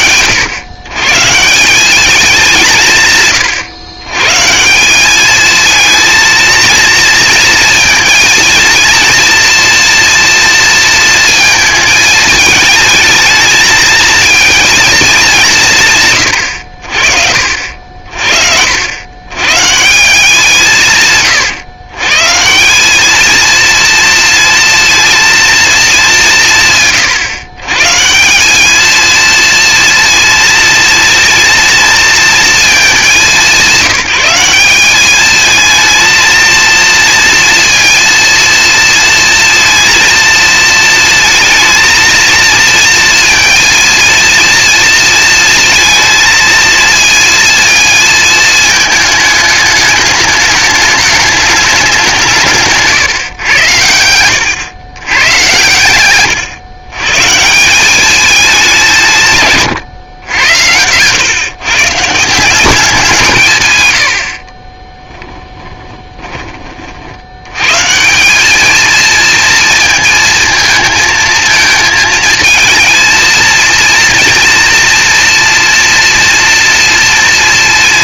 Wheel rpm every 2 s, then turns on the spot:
130, 160, 190, 230, 240, 230, 220, 220, 60, 80, 170, 180, 230, 150, 220, 230, 210, 200, 230, 230, 230, 230, 230, 230, 220, 210, 140, 110, 130, 180, 100, 180, 30, 30, 210, 230, 220, 230, 240.
52-54 64-66